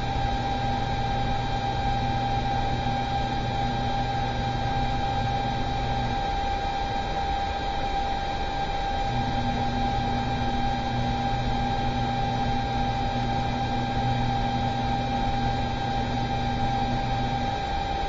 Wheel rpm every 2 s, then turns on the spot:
0, 0, 0, 0, 0, 0, 0, 0, 0.
none